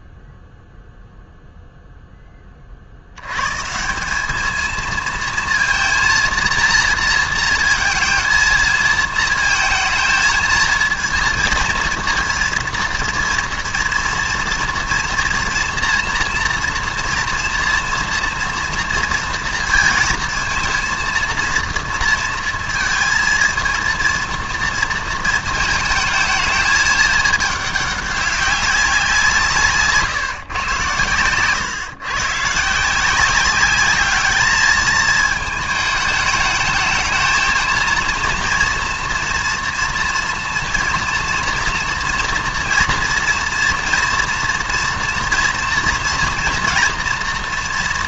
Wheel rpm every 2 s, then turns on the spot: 0, 40, 220, 230, 220, 220, 230, 230, 230, 230, 230, 220, 230, 220, 200, 130, 140, 220, 210, 230, 230, 240, 230, 230.
none